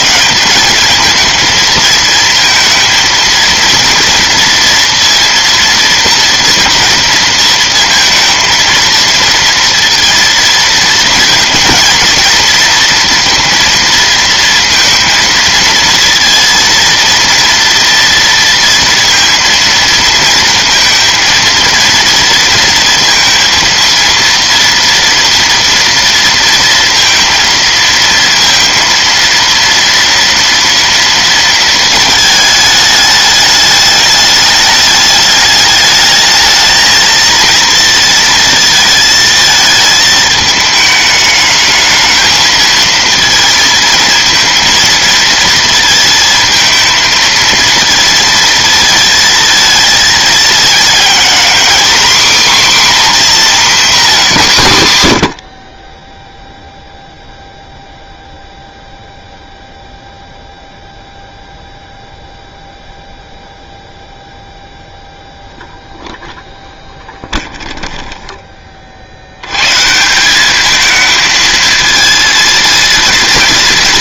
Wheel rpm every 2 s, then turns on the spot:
110, 220, 230, 230, 220, 230, 230, 230, 230, 230, 230, 230, 230, 230, 230, 230, 230, 210, 210, 230, 220, 220, 230, 230, 230, 220, 260, 220, 20, 0, 0, 0, 0, 0, 20, 210, 230.
none